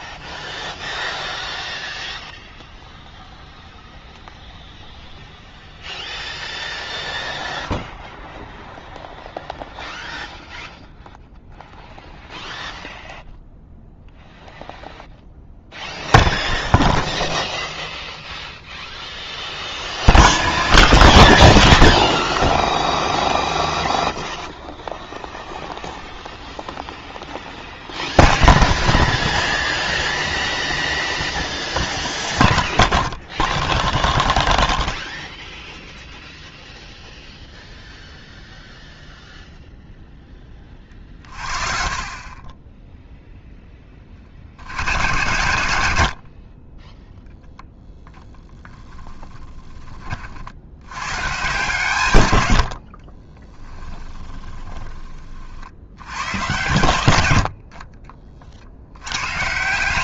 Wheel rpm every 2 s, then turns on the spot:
0, 0, 0, 0, 0, 0, 0, 0, 0, 0, 0, 0, 0, 0, 0, 0, 0, 0, 0, 0, 20, 20, 70, 40, 10, 70, 90, 20, 110, 60.
48-50 52-56